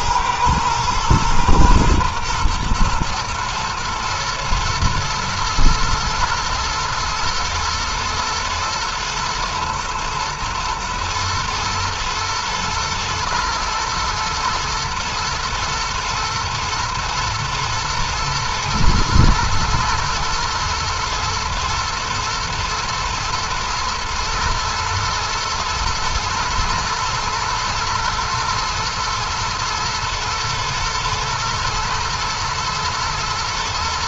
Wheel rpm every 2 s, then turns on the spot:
110, 110, 120, 110, 110, 110, 110, 120, 110, 110, 120, 120, 110, 110, 120, 110, 120.
none